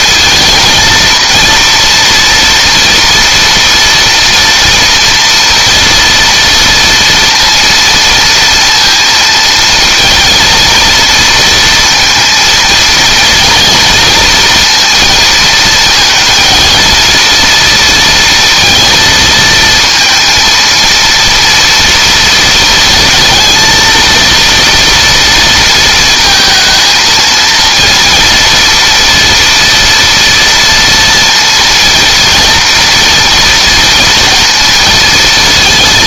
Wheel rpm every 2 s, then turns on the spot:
230, 230, 230, 230, 230, 230, 230, 230, 230, 230, 230, 230, 230, 230, 230, 230, 230, 230.
none